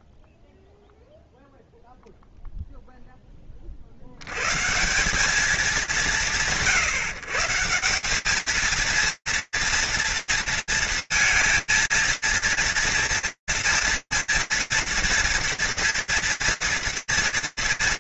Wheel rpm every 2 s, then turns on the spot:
0, 10, 160, 140, 230, 230, 230, 230, 230.
none